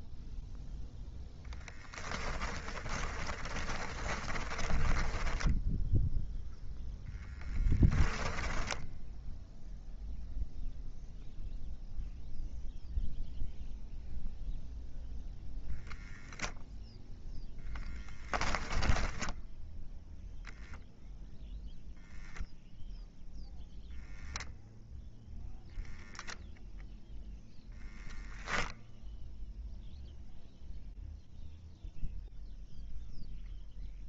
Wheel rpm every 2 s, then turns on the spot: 0, 30, 20, 0, 10, 0, 0, 0, 0, 10, 0, 0, 0, 0, 0, 0, 0.
2-6 8-10 18-20